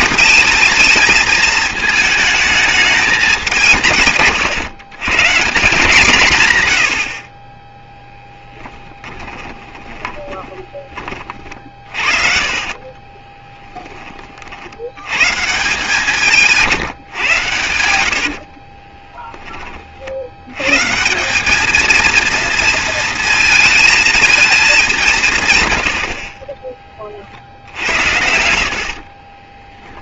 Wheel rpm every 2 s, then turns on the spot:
220, 210, 140, 90, 20, 20, 30, 80, 150, 30, 140, 230, 200, 30, 50.
8-10 12-14 16-20 28-30